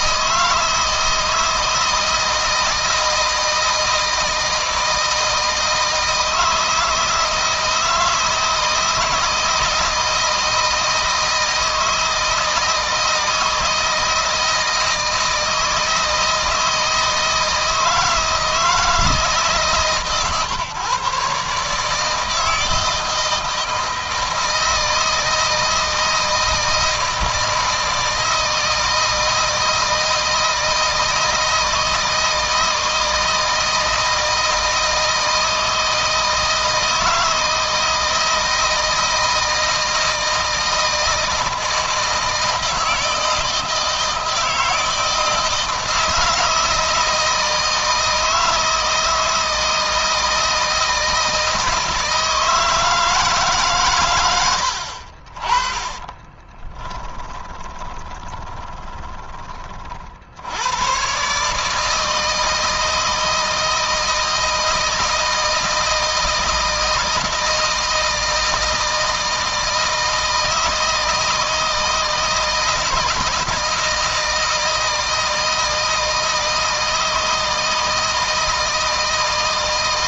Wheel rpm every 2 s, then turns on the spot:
160, 160, 160, 160, 160, 160, 160, 160, 160, 160, 130, 160, 160, 160, 160, 160, 160, 160, 160, 160, 160, 160, 160, 160, 160, 160, 160, 60, 20, 10, 110, 160, 160, 170, 160, 160, 160, 160, 160, 160.
56-60